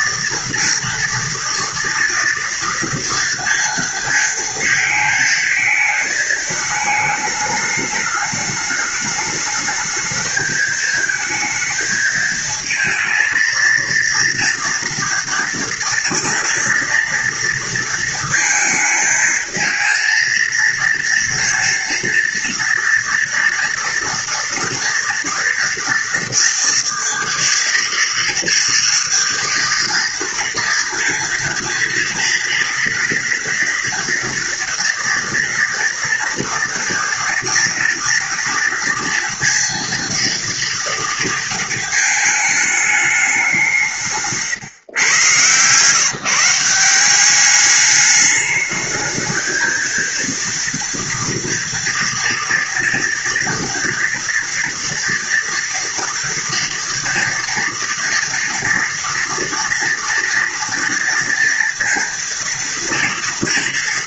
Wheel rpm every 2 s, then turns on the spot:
230, 230, 230, 210, 210, 220, 220, 230, 230, 220, 230, 230, 230, 230, 230, 230, 230, 230, 230, 230, 230, 210, 130, 180, 220, 230, 240, 230, 230, 230, 230, 230.
none